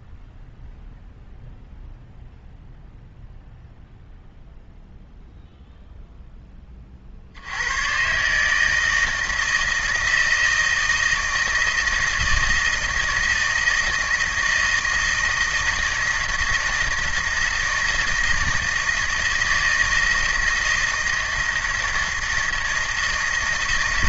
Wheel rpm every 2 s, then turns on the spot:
0, 0, 0, 30, 160, 160, 160, 160, 160, 160, 160, 160.
none